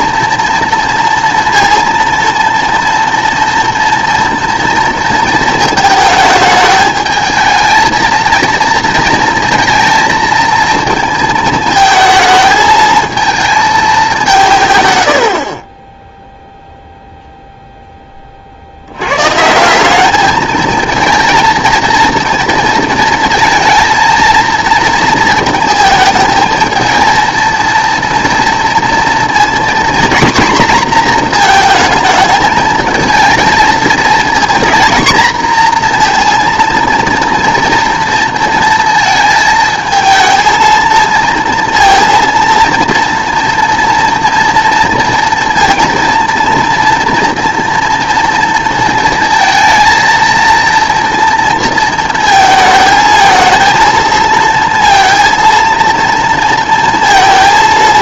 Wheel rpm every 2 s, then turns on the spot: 230, 230, 230, 210, 230, 230, 220, 140, 0, 70, 220, 230, 230, 220, 240, 240, 220, 230, 230, 230, 230, 230, 230, 230, 230, 230, 220, 230, 230.
none